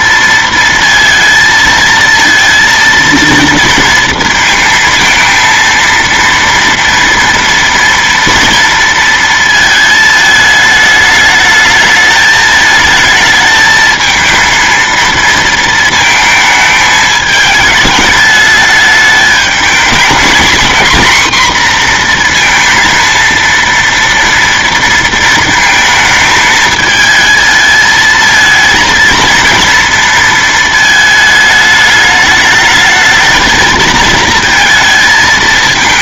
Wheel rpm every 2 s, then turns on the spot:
230, 230, 230, 230, 230, 220, 220, 230, 220, 210, 230, 230, 230, 220, 230, 220, 210, 220.
none